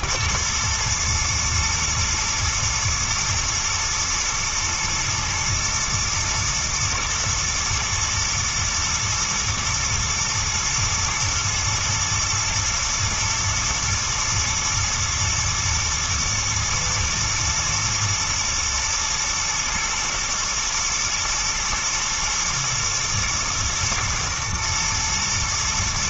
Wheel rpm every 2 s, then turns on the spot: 120, 120, 120, 110, 120, 120, 120, 120, 110, 120, 110, 120, 110.
none